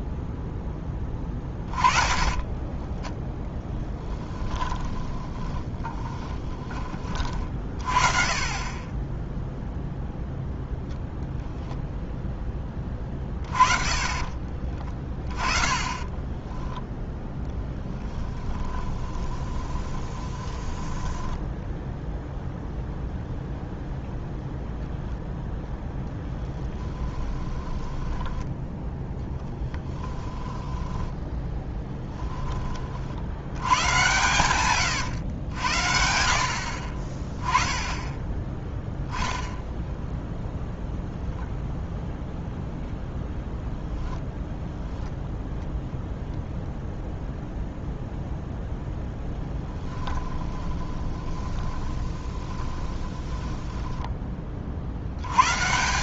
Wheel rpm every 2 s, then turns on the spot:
10, 10, 10, 20, 20, 0, 30, 30, 10, 20, 20, 0, 0, 20, 10, 10, 40, 120, 50, 10, 0, 0, 0, 0, 0, 20, 30, 50.
2-6 14-22 26-28 30-32 34-36 50-54